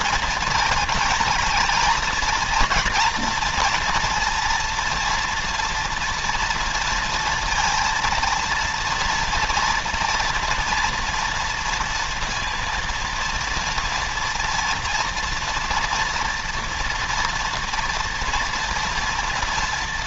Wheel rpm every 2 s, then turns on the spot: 230, 230, 230, 230, 230, 230, 230, 230, 230, 240.
none